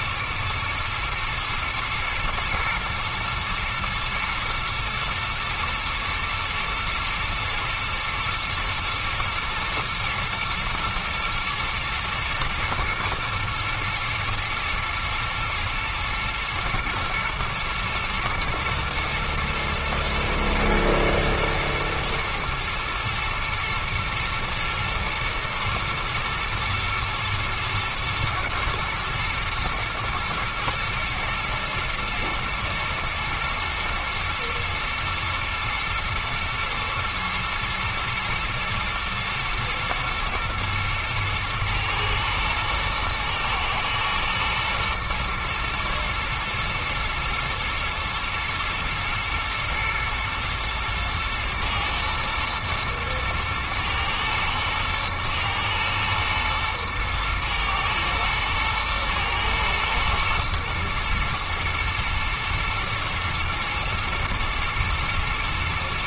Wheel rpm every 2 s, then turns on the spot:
120, 110, 110, 110, 120, 110, 110, 110, 110, 120, 120, 110, 120, 110, 110, 120, 110, 110, 120, 120, 110, 110, 110, 110, 120, 120, 110, 110, 120, 110, 120, 110, 110.
none